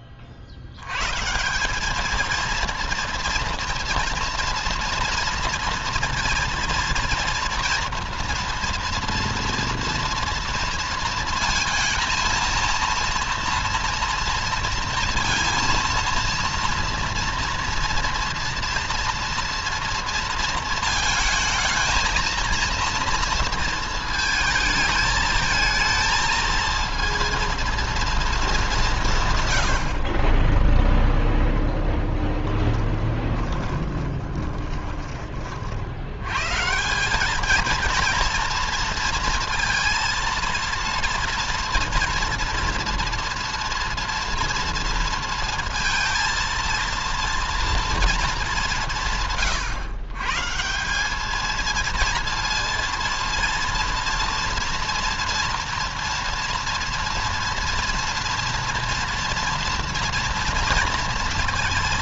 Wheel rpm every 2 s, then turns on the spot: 100, 230, 230, 230, 230, 230, 230, 230, 230, 230, 230, 230, 220, 230, 170, 0, 20, 20, 170, 230, 230, 230, 230, 230, 180, 170, 230, 230, 230, 230, 230.
32-34